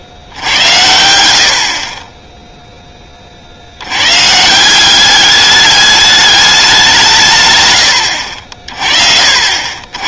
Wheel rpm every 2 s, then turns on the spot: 60, 20, 180, 180, 50.
none